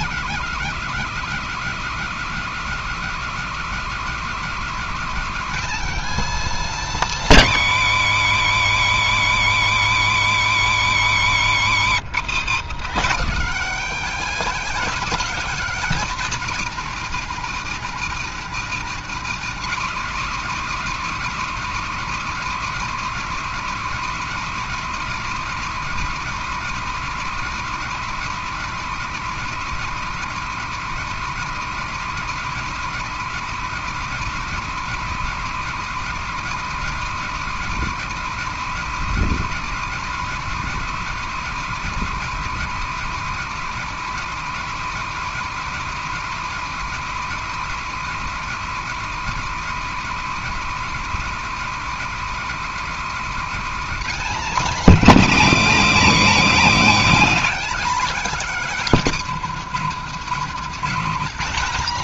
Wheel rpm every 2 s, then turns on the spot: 260, 250, 250, 260, 150, 150, 190, 270, 230, 220, 240, 240, 240, 240, 240, 240, 240, 240, 240, 250, 240, 250, 240, 240, 240, 240, 250, 260, 260, 260, 210.
none